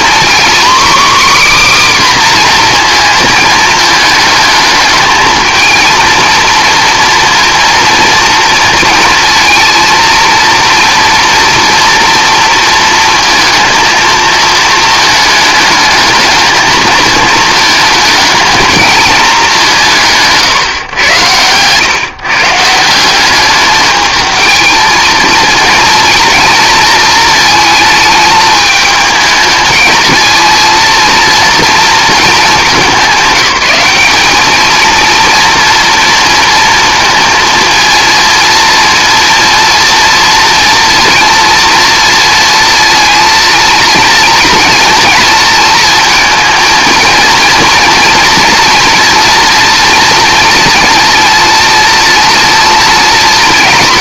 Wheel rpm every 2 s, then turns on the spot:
270, 250, 220, 230, 230, 230, 230, 220, 220, 220, 150, 160, 220, 230, 220, 230, 210, 220, 230, 230, 230, 230, 230, 220, 230, 230, 230.
none